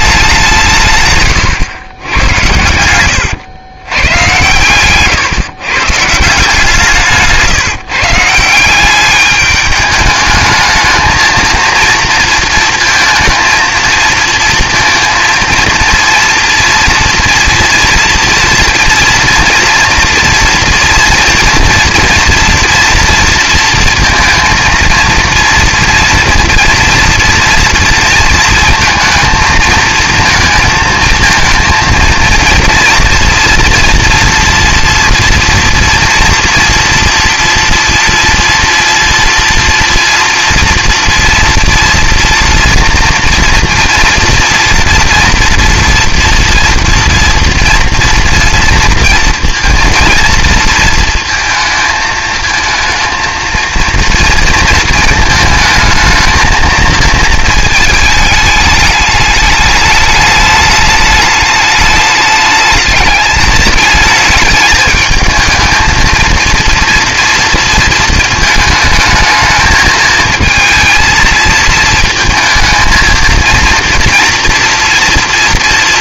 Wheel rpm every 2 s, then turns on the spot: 150, 100, 130, 170, 180, 220, 220, 230, 230, 230, 230, 230, 230, 230, 220, 230, 230, 230, 230, 230, 240, 230, 230, 230, 230, 230, 220, 230, 220, 210, 210, 210, 220, 230, 220, 230, 230, 230.
4-6